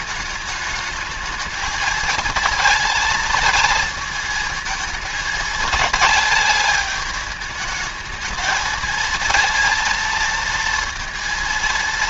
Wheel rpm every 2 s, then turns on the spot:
210, 220, 220, 210, 220, 230.
none